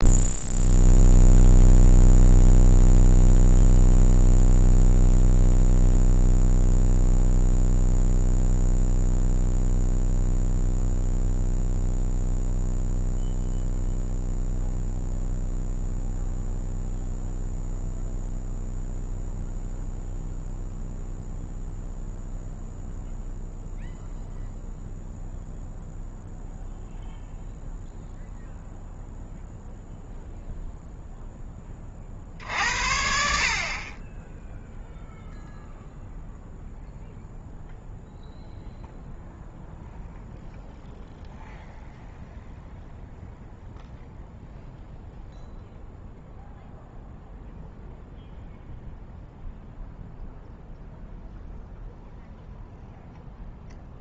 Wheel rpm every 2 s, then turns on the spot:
0, 0, 0, 0, 0, 0, 0, 0, 0, 0, 0, 0, 0, 0, 0, 0, 70, 0, 0, 0, 0, 0, 0, 0, 0, 0, 0.
none